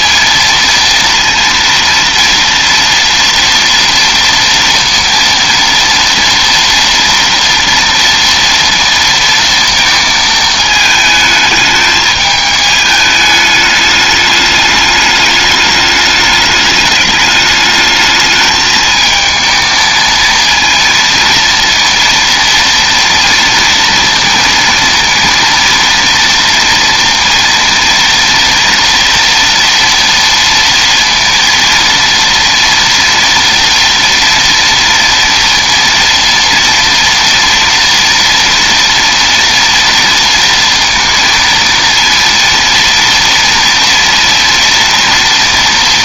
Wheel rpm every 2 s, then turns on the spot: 230, 230, 230, 230, 230, 220, 210, 210, 210, 220, 230, 240, 230, 230, 230, 230, 240, 230, 230, 230, 230, 230, 230.
none